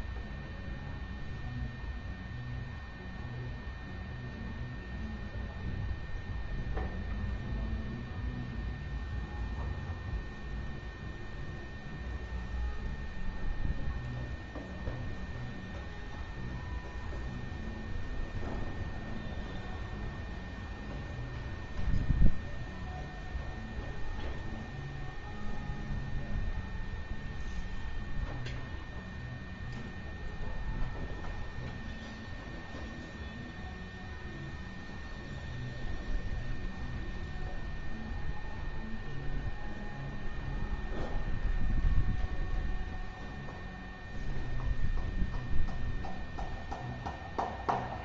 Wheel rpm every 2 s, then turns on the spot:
0, 0, 0, 0, 0, 0, 0, 0, 0, 0, 0, 0, 0, 0, 0, 0, 0, 0, 0, 0, 0, 0, 0, 0.
none